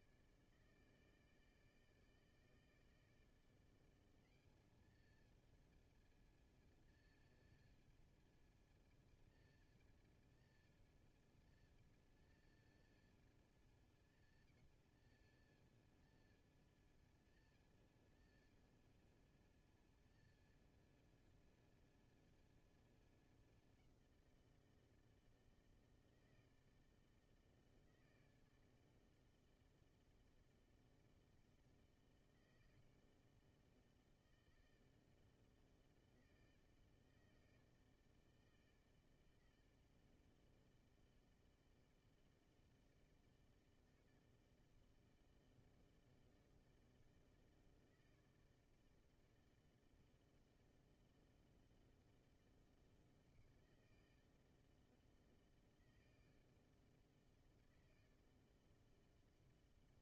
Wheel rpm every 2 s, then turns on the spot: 150, 150, 210, 230, 230, 230, 230, 230, 230, 230, 230, 230, 170, 160, 160, 160, 160, 160, 160, 160, 160, 160, 160, 160, 160, 160, 160, 160, 160, 160.
none